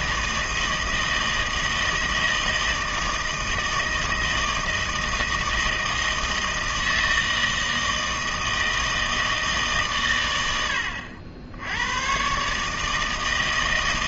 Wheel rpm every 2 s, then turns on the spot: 160, 160, 160, 160, 160, 90, 150.
none